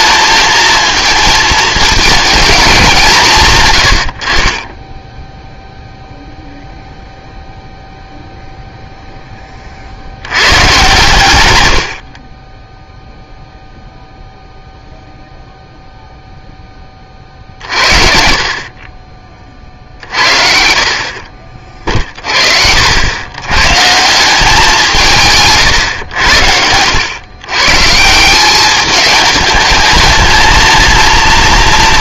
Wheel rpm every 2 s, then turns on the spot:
220, 190, 20, 0, 0, 110, 0, 0, 20, 40, 60, 70, 170, 90, 200, 230.
none